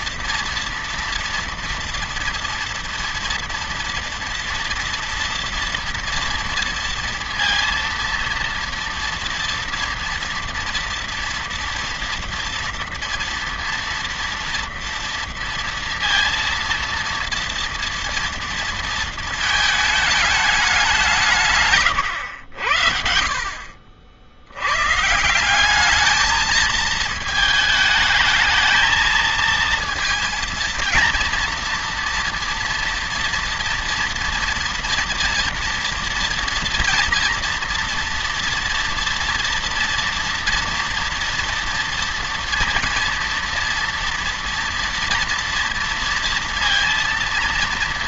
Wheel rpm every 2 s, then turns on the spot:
230, 230, 230, 230, 230, 230, 230, 230, 230, 230, 190, 70, 110, 220, 220, 230, 230, 230, 230, 230, 240, 230, 230, 230.
none